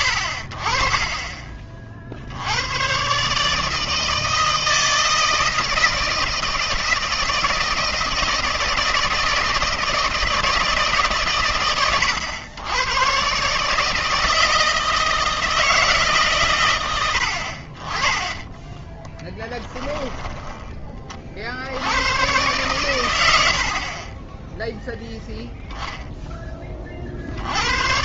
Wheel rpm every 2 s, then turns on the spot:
50, 100, 160, 160, 160, 160, 110, 160, 120, 20, 20, 120, 0, 20.
18-20